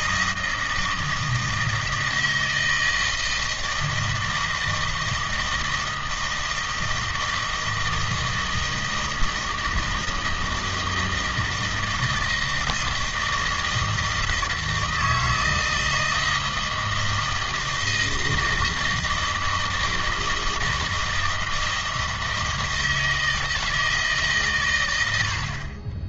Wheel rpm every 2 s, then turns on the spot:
160, 160, 160, 160, 160, 160, 160, 160, 160, 160, 160, 160, 110.
none